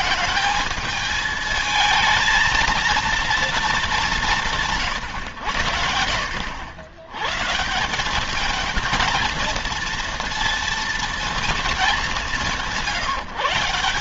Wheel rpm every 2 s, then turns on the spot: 220, 230, 180, 80, 210, 230, 180.
none